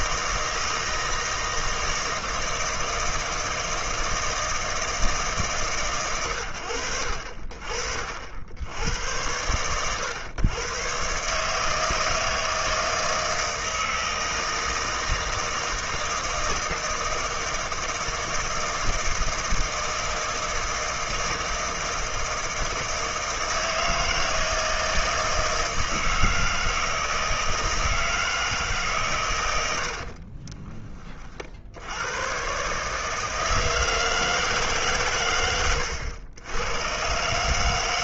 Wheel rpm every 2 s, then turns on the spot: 160, 160, 160, 80, 110, 120, 160, 160, 160, 160, 160, 160, 160, 160, 140, 20, 150, 130, 120.
none